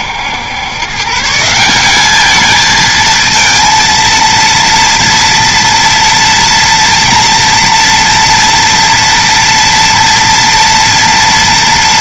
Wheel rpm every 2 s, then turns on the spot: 140, 220, 230, 230, 230, 230.
none